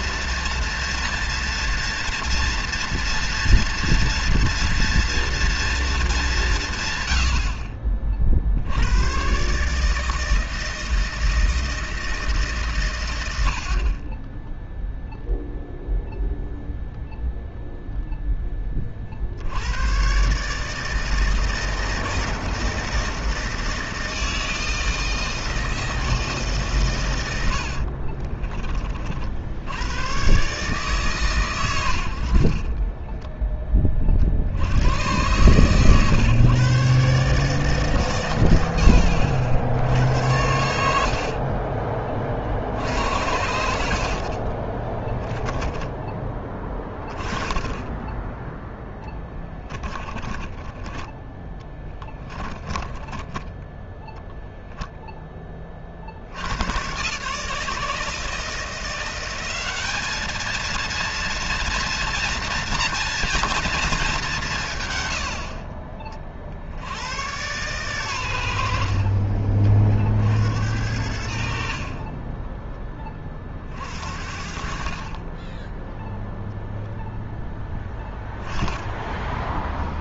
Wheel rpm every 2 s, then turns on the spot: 230, 230, 230, 150, 80, 160, 140, 10, 0, 20, 150, 160, 160, 140, 30, 130, 40, 60, 130, 100, 80, 60, 20, 20, 10, 10, 20, 0, 90, 170, 230, 230, 160, 60, 80, 70, 20, 50, 0, 10.
32-34 40-42 44-46 52-54